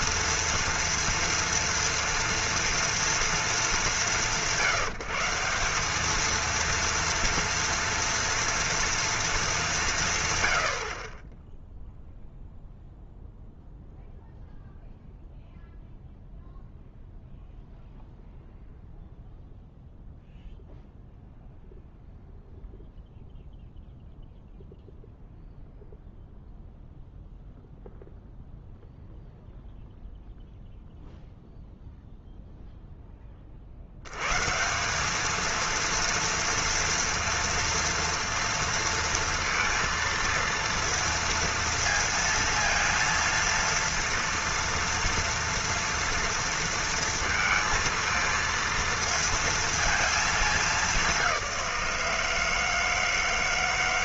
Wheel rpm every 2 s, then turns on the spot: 230, 230, 140, 230, 230, 90, 0, 0, 0, 0, 0, 0, 0, 0, 0, 0, 0, 170, 230, 230, 230, 230, 230, 230, 230, 210, 160.
none